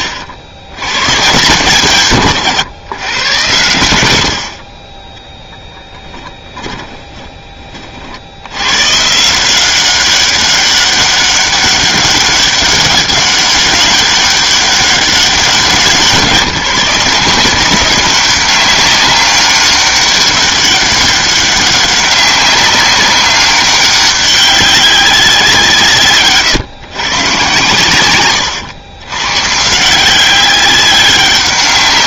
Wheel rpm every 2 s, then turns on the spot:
90, 130, 20, 20, 130, 200, 200, 200, 170, 190, 200, 190, 190, 120, 100, 200.
6-8